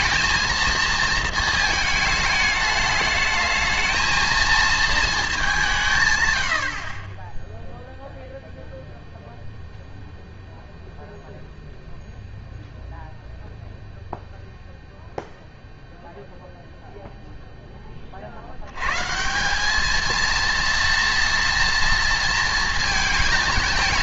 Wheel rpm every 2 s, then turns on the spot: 230, 210, 230, 90, 0, 0, 0, 0, 0, 80, 230, 230.
none